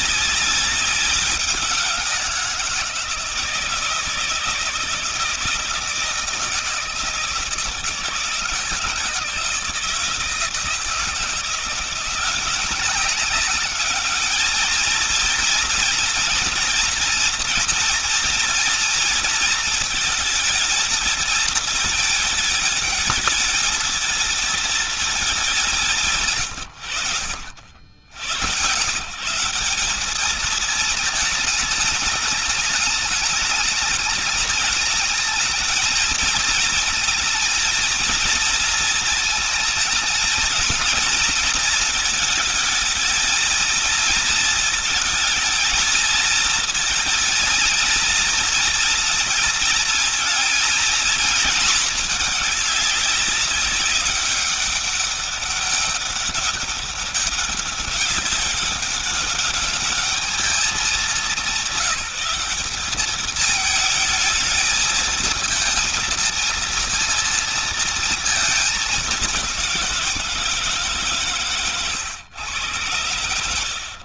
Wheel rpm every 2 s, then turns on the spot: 200, 170, 160, 170, 160, 160, 180, 210, 230, 230, 220, 220, 230, 110, 110, 220, 210, 210, 230, 230, 220, 220, 220, 230, 230, 230, 210, 200, 200, 200, 210, 200, 220, 230, 220, 160, 110.
none